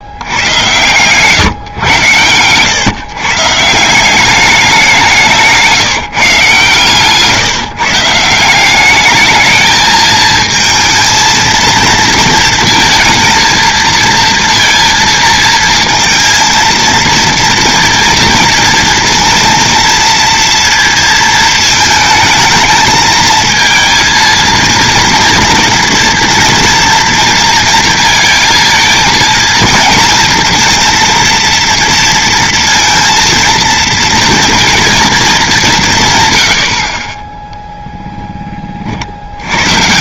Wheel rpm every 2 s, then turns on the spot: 100, 120, 200, 140, 180, 220, 230, 230, 230, 230, 230, 220, 230, 230, 230, 230, 230, 230, 100, 30.
none